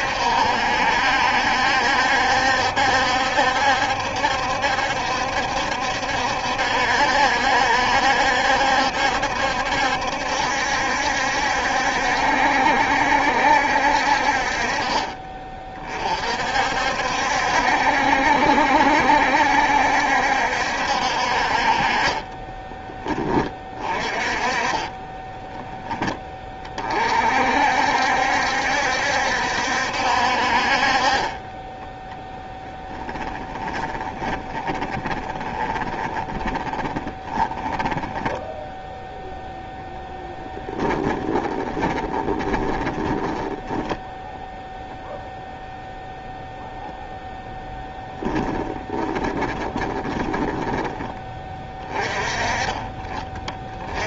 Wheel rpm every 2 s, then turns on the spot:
70, 70, 70, 70, 70, 70, 70, 20, 60, 70, 70, 20, 20, 40, 70, 40, 10, 20, 30, 0, 10, 30, 0, 0, 10, 20, 30.
24-26 32-38 40-44 48-52